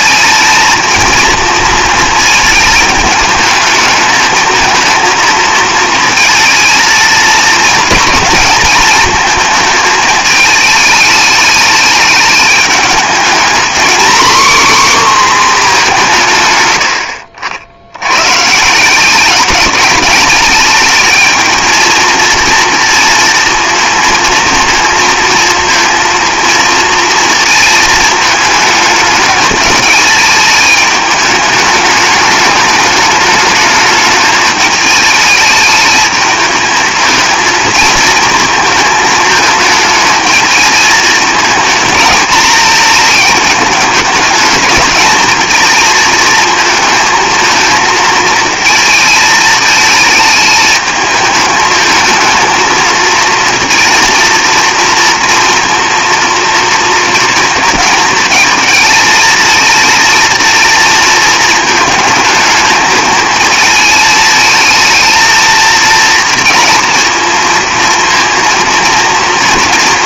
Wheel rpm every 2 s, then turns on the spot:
220, 220, 220, 230, 220, 220, 210, 270, 120, 150, 210, 230, 230, 220, 210, 220, 210, 210, 220, 220, 220, 220, 210, 220, 220, 220, 220, 230, 230, 220, 230, 220, 220, 230, 230.
none